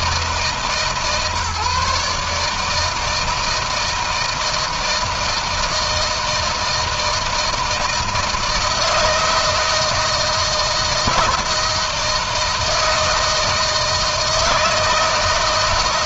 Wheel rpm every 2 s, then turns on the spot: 140, 160, 160, 160, 170, 160, 160, 160.
none